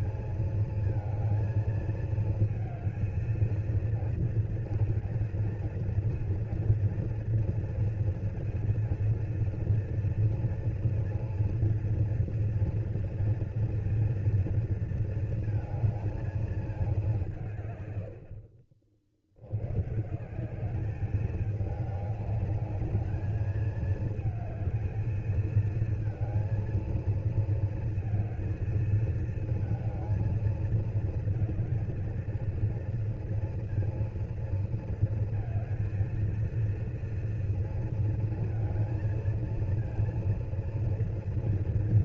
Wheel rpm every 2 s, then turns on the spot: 230, 220, 230, 230, 230, 230, 230, 230, 220, 60, 180, 210, 220, 220, 220, 220, 220, 230, 220, 230, 230.
none